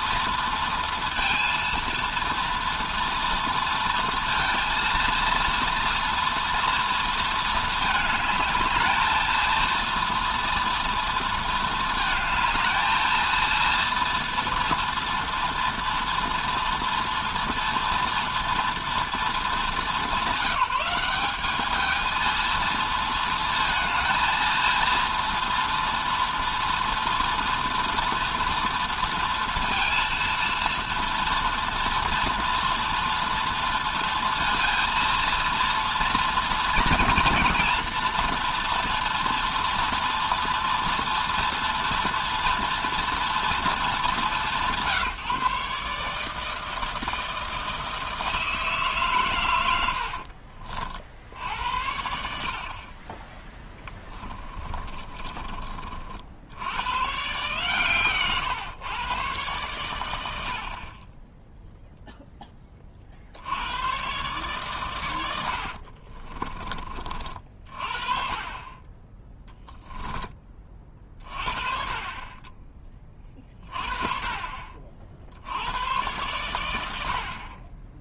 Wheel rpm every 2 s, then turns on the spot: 230, 230, 230, 230, 220, 230, 220, 230, 230, 230, 190, 220, 230, 230, 230, 230, 230, 230, 230, 230, 230, 230, 140, 160, 150, 40, 50, 30, 100, 120, 60, 20, 130, 30, 20, 30, 20, 40, 100.
54-56